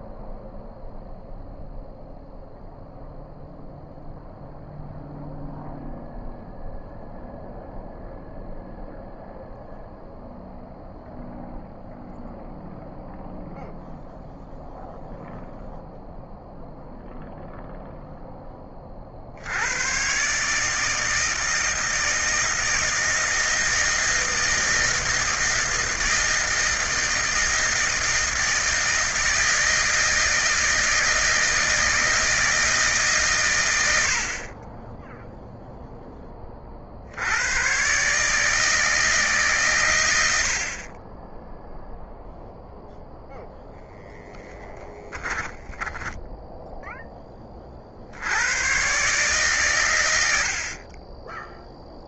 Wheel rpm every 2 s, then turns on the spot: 0, 0, 0, 0, 0, 0, 0, 0, 0, 20, 150, 160, 160, 160, 160, 160, 160, 30, 40, 160, 50, 0, 10, 0, 110, 50.
44-46